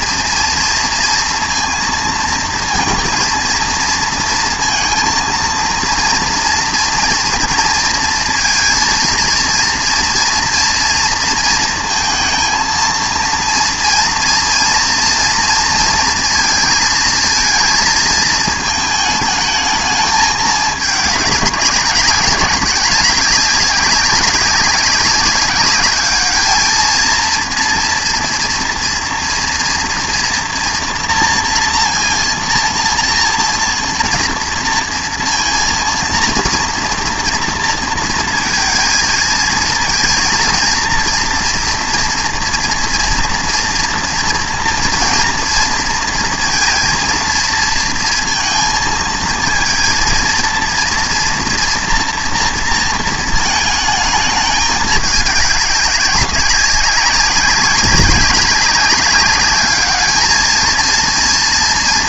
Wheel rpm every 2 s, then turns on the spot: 230, 230, 230, 240, 230, 230, 230, 230, 230, 220, 210, 190, 200, 220, 230, 230, 230, 230, 230, 230, 240, 240, 230, 230, 230, 230, 230, 210, 200, 200, 220.
none